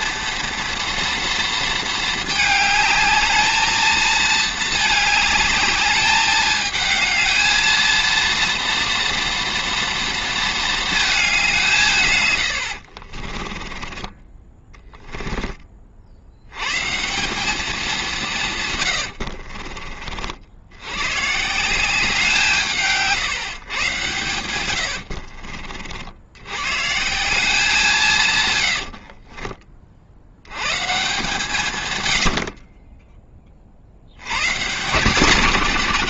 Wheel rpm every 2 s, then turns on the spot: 230, 210, 220, 210, 230, 220, 70, 20, 130, 140, 80, 150, 100, 130, 110, 120, 30, 130.
12-16 28-30